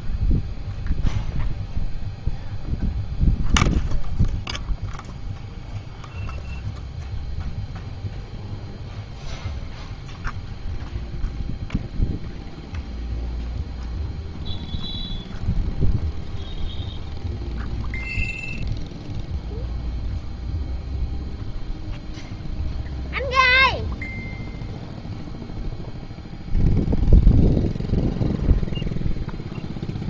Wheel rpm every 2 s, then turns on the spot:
0, 0, 0, 0, 0, 0, 0, 0, 0, 0, 0, 0, 0, 0, 0.
none